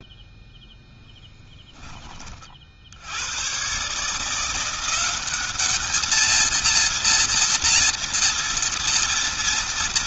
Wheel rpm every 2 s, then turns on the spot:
10, 70, 190, 230, 230.
0-2